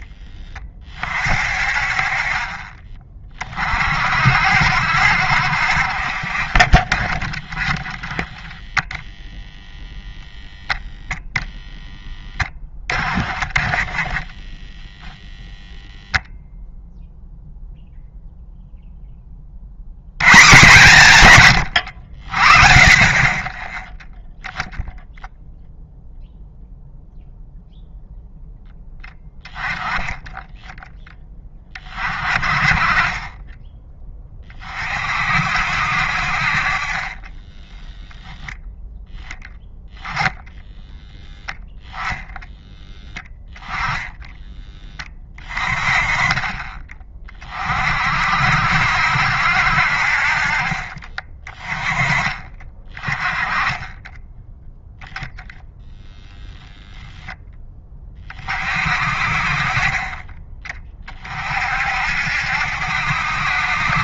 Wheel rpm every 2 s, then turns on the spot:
30, 40, 60, 30, 0, 0, 20, 10, 0, 0, 130, 40, 0, 0, 10, 10, 30, 30, 40, 10, 0, 10, 10, 20, 70, 40, 20, 0, 10, 40, 30, 70.
6-8 50-52